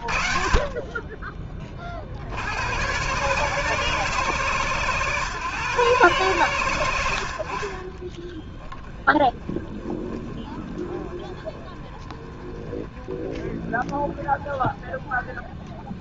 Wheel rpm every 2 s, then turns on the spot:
70, 70, 130, 110, 20, 20, 20, 20.
none